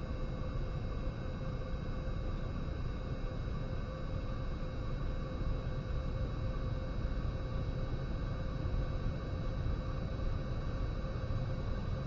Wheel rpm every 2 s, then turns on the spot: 0, 0, 0, 0, 0, 0.
none